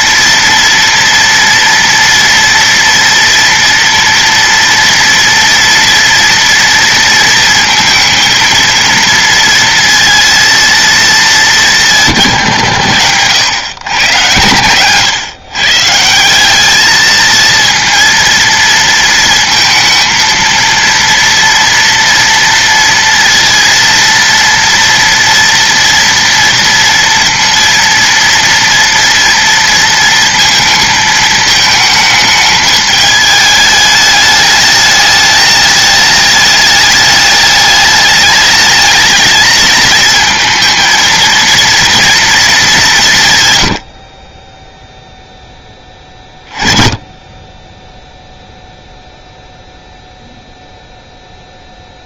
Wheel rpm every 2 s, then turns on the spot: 240, 230, 230, 230, 230, 230, 130, 110, 210, 230, 230, 230, 230, 230, 230, 220, 210, 210, 210, 220, 220, 210, 0, 20, 0, 0.
none